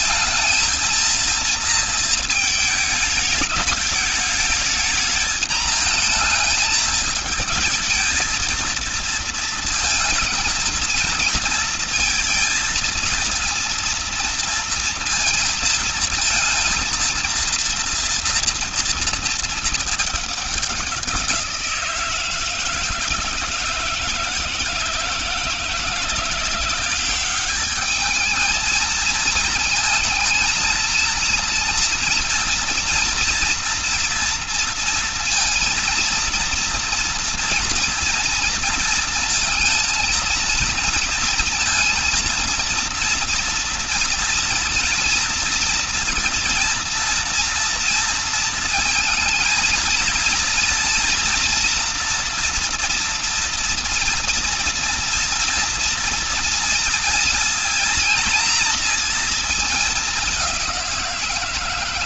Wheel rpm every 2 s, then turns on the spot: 230, 220, 220, 230, 230, 230, 230, 230, 230, 230, 200, 160, 160, 180, 220, 230, 230, 230, 230, 230, 220, 230, 230, 230, 230, 230, 240, 230, 230, 230, 190.
none